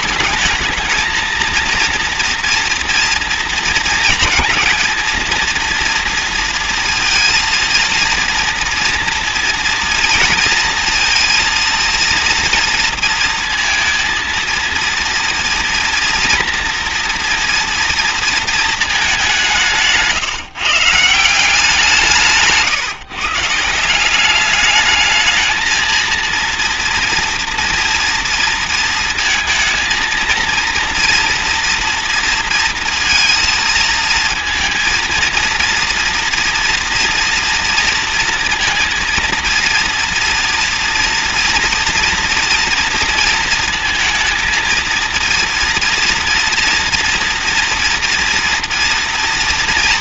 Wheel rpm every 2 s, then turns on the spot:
220, 230, 230, 230, 230, 230, 230, 230, 240, 230, 140, 160, 200, 230, 230, 230, 230, 230, 230, 230, 230, 230, 230, 240, 230.
none